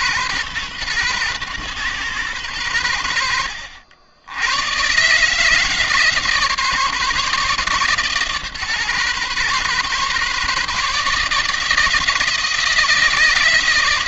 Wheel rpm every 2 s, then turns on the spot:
120, 100, 110, 150, 140, 150, 160.
none